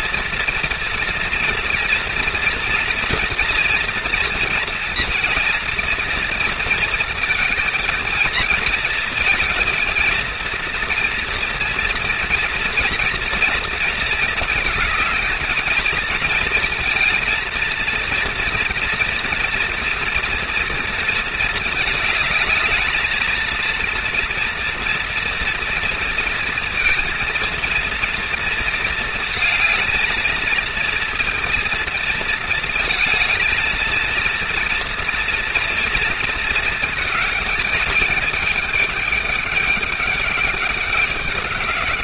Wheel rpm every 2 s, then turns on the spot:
230, 230, 230, 230, 230, 240, 220, 220, 230, 230, 220, 230, 230, 230, 220, 230, 230, 230, 220, 210, 200.
none